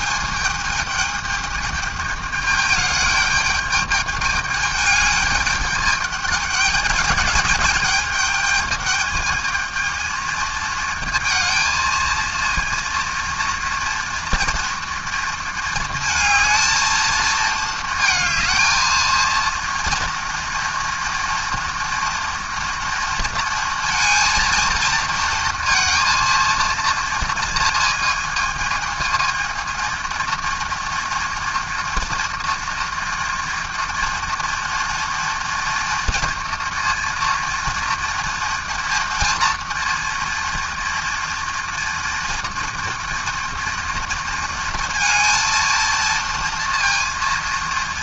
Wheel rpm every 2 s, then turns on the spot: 220, 210, 210, 210, 220, 220, 230, 230, 220, 230, 230, 230, 230, 230, 220, 240, 240, 240, 240, 230, 230, 230, 230, 230.
none